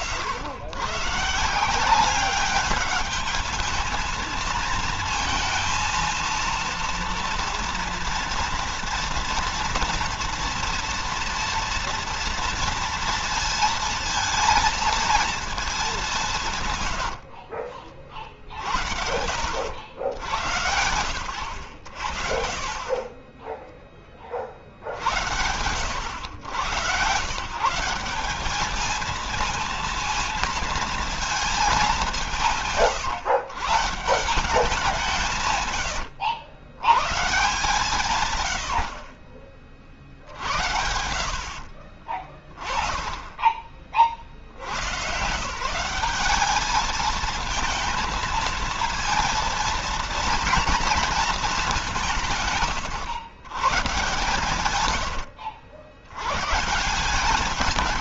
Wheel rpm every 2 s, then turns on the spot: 130, 210, 230, 230, 230, 230, 230, 230, 90, 60, 90, 20, 60, 110, 220, 230, 130, 170, 120, 70, 70, 20, 110, 210, 230, 230, 120, 120, 160.
16-18 22-24 38-40 54-56